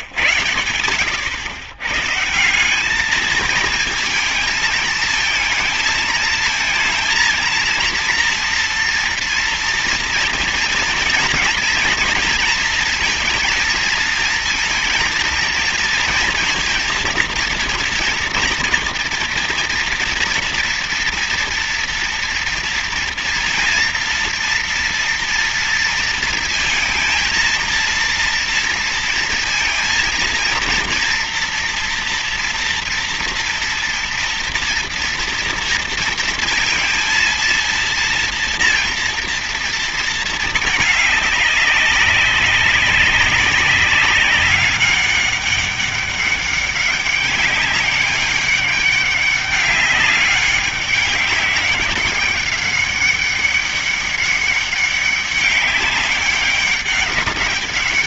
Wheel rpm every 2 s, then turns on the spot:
110, 180, 220, 230, 230, 230, 230, 230, 230, 230, 230, 230, 230, 230, 230, 230, 230, 230, 230, 230, 220, 200, 200, 200, 200, 200, 200, 200, 200.
none